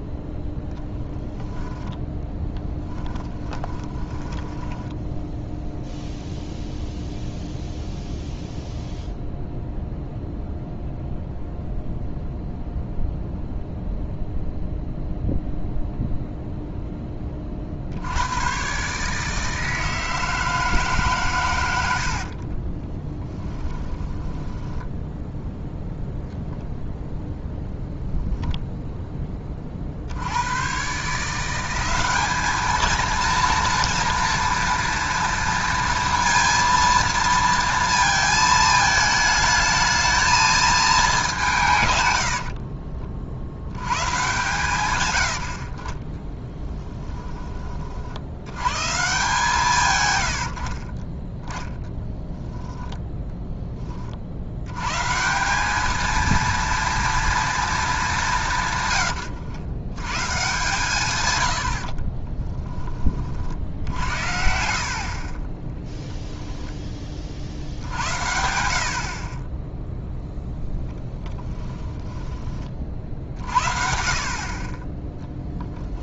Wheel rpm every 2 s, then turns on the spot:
0, 10, 10, 0, 0, 0, 0, 0, 0, 120, 160, 20, 10, 0, 0, 100, 220, 230, 230, 220, 220, 50, 130, 10, 110, 50, 0, 110, 230, 170, 150, 10, 60, 10, 70, 0, 30, 40.
4-6 22-26 42-44 46-48 64-66